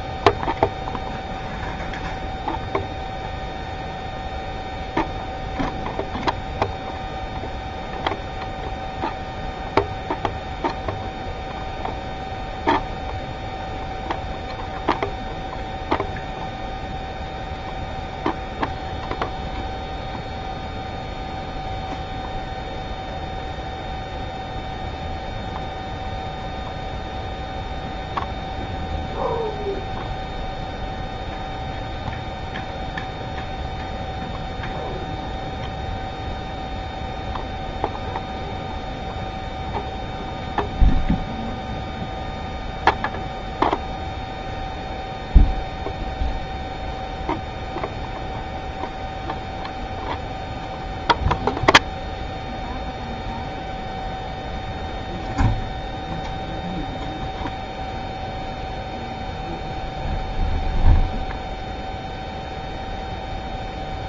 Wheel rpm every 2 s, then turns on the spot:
0, 0, 0, 0, 0, 0, 0, 0, 0, 0, 0, 0, 0, 0, 0, 0, 0, 0, 0, 0, 0, 0, 0, 0, 0, 0, 0, 0, 0, 0, 0, 0.
none